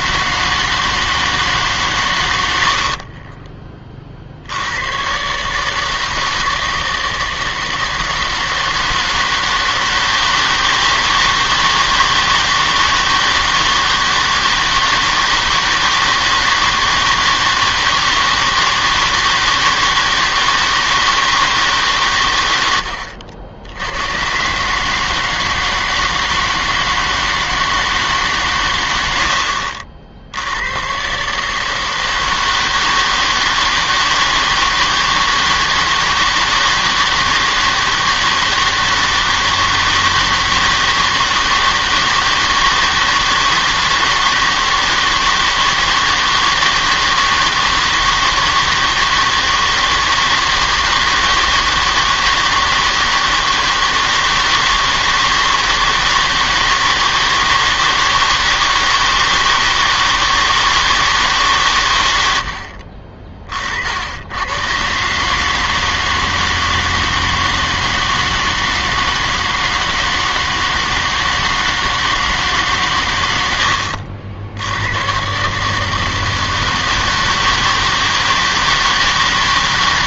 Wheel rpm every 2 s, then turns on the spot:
160, 70, 80, 160, 160, 160, 160, 160, 160, 160, 160, 90, 140, 160, 120, 90, 160, 160, 160, 160, 160, 160, 160, 160, 160, 160, 160, 160, 160, 160, 160, 60, 100, 160, 160, 160, 130, 80, 160, 160.
2-4